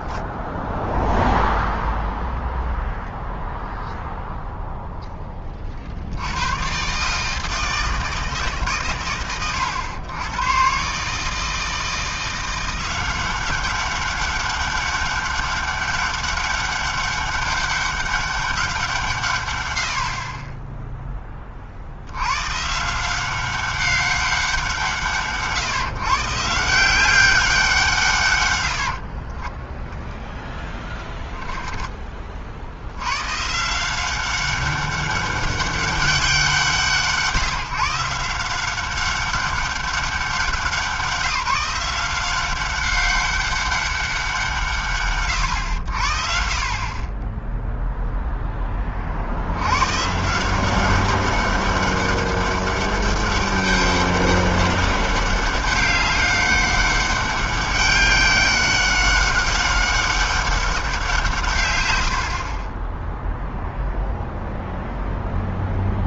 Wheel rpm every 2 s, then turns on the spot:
0, 0, 100, 150, 100, 170, 200, 200, 190, 40, 100, 190, 150, 180, 0, 30, 180, 190, 150, 200, 180, 200, 80, 0, 130, 200, 200, 200, 200, 190, 120, 0, 0.
none